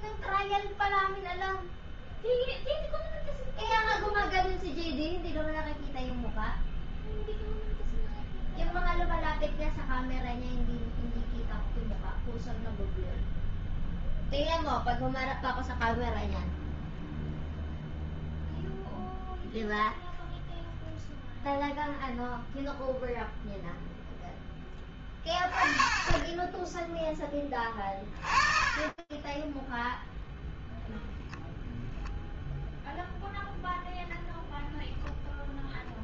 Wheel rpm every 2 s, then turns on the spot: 0, 0, 0, 0, 0, 0, 0, 0, 0, 0, 0, 0, 10, 10, 30, 0, 0, 0.
none